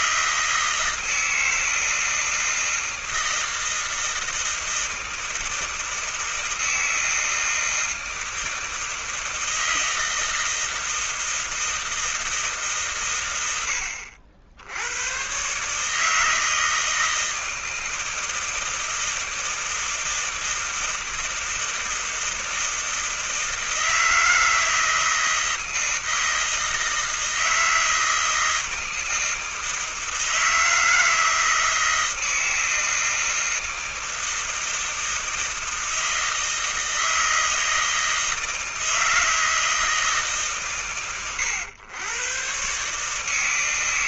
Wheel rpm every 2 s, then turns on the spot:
160, 160, 160, 160, 160, 160, 160, 80, 150, 160, 160, 160, 160, 160, 160, 160, 160, 160, 160, 160, 140, 120.
none